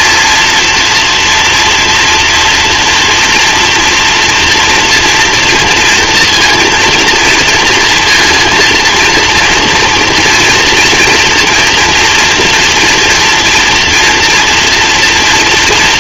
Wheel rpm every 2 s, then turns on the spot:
230, 230, 230, 230, 230, 230, 230, 240.
none